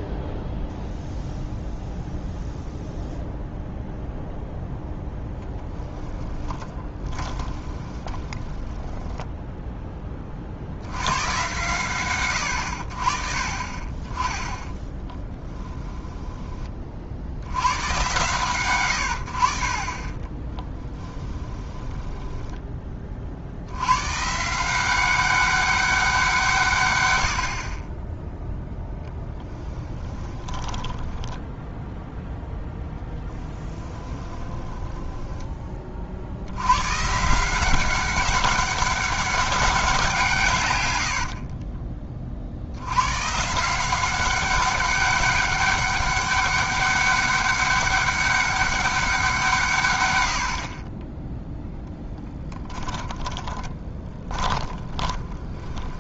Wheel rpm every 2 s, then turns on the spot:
0, 0, 0, 10, 20, 60, 70, 20, 30, 120, 20, 20, 170, 130, 0, 20, 10, 20, 110, 200, 130, 70, 200, 200, 200, 50, 10, 20.
6-10 14-16 20-22 30-36 52-56